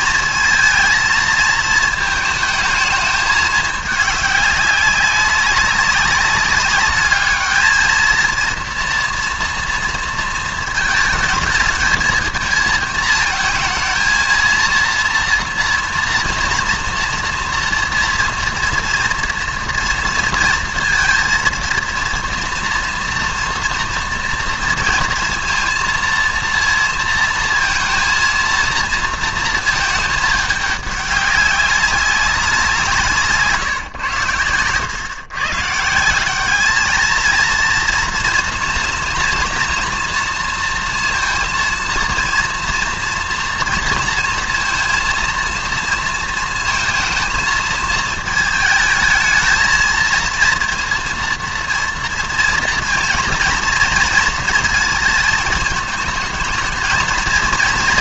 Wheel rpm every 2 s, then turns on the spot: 220, 220, 200, 200, 230, 220, 220, 230, 230, 230, 220, 230, 230, 230, 230, 210, 190, 100, 200, 230, 230, 230, 230, 230, 220, 230, 230, 230, 220.
none